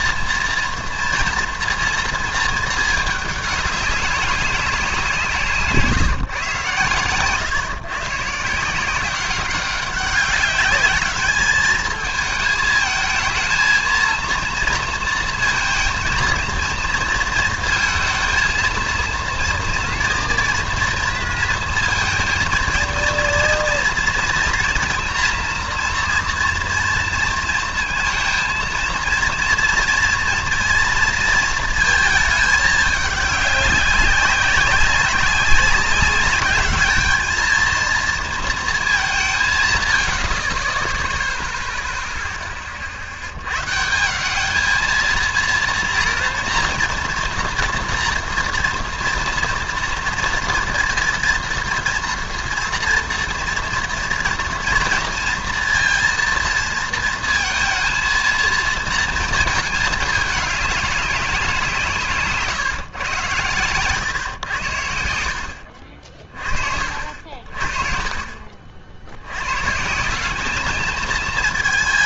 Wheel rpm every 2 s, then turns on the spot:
230, 230, 190, 130, 160, 200, 220, 230, 230, 230, 230, 230, 230, 230, 230, 230, 210, 190, 210, 220, 40, 20, 210, 230, 230, 230, 230, 230, 230, 230, 210, 140, 100, 40, 50, 210.
none